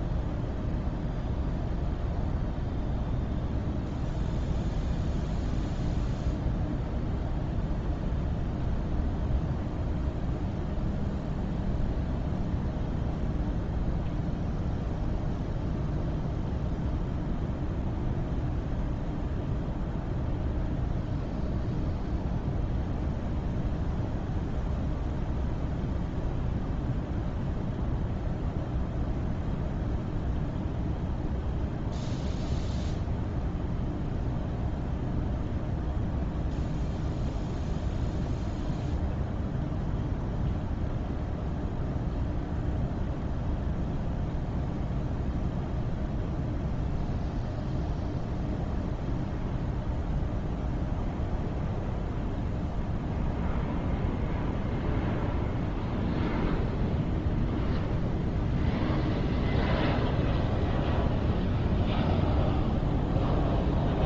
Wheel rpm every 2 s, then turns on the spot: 0, 0, 0, 0, 0, 0, 0, 0, 0, 0, 0, 0, 0, 0, 0, 0, 0, 0, 0, 0, 0, 0, 0, 0, 0, 0, 0, 0, 0, 0, 0, 0.
none